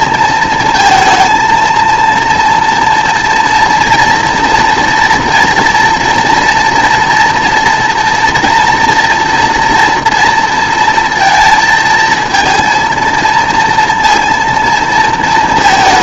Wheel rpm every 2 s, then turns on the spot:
220, 230, 230, 230, 230, 230, 230, 230.
none